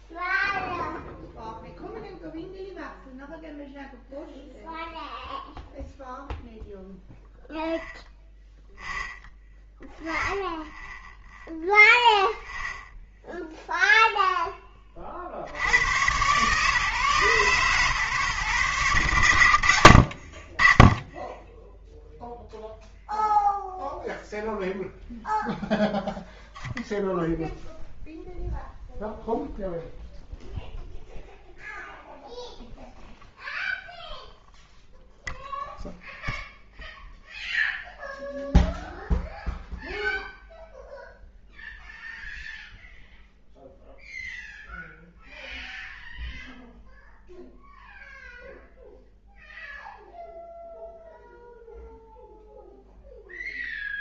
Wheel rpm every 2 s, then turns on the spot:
0, 0, 0, 0, 0, 0, 0, 20, 130, 110, 20, 0, 0, 0, 0, 0, 0, 0, 0, 0, 0, 0, 0, 0, 0, 0, 0.
none